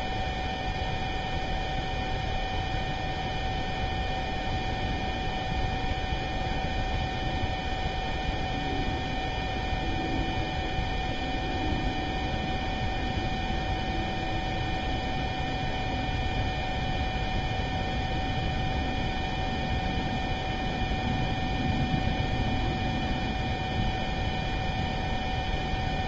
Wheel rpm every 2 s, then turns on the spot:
0, 0, 0, 0, 0, 0, 0, 0, 0, 0, 0, 0, 0.
none